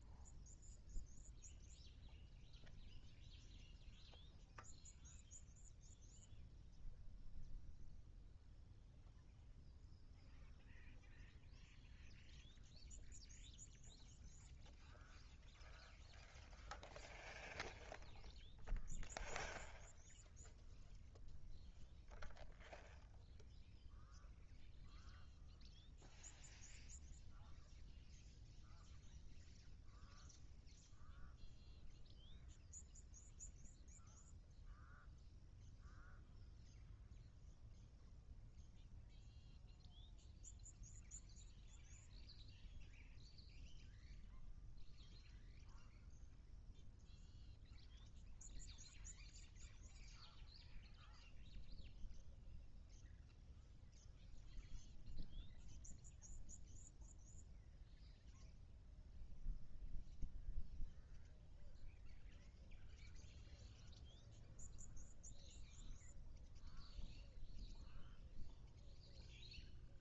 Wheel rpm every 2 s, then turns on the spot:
0, 0, 0, 0, 0, 0, 0, 0, 0, 0, 0, 0, 0, 0, 0, 0, 0, 0, 0, 0, 0, 0, 0, 0, 0, 0, 0, 0, 0, 0, 0, 0, 0, 0, 0.
none